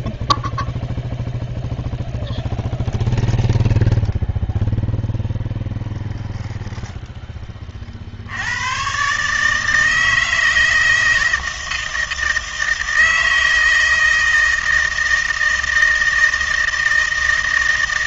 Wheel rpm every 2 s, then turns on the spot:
0, 0, 0, 0, 110, 160, 160, 160, 160.
none